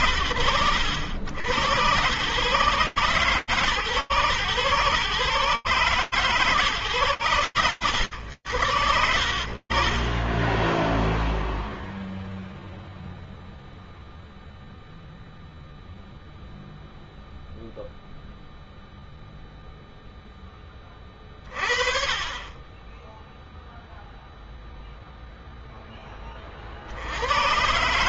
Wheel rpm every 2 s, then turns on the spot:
100, 130, 140, 120, 60, 0, 0, 0, 0, 0, 30, 0, 10, 140.
none